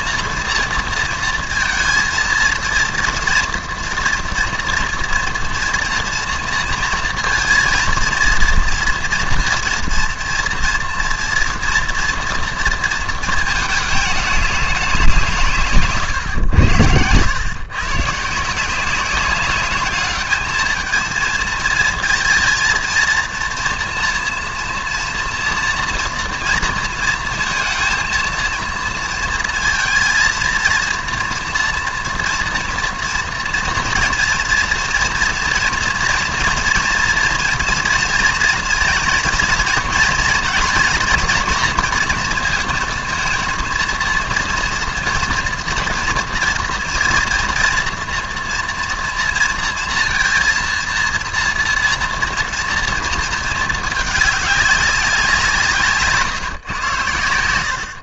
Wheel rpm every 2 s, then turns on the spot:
230, 230, 230, 230, 230, 230, 230, 190, 100, 170, 220, 230, 230, 230, 230, 230, 230, 230, 230, 230, 230, 230, 230, 230, 230, 230, 230, 200, 120.
none